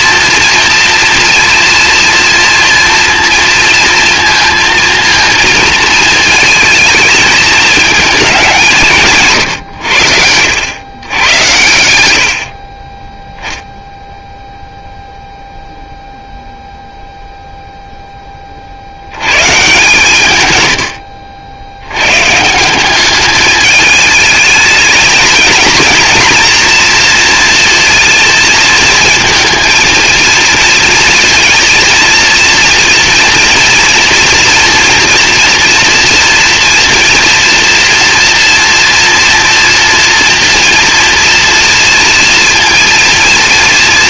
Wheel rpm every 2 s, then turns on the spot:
240, 230, 230, 220, 150, 110, 20, 0, 0, 60, 100, 170, 220, 240, 230, 230, 230, 230, 230, 230, 230, 230.
20-22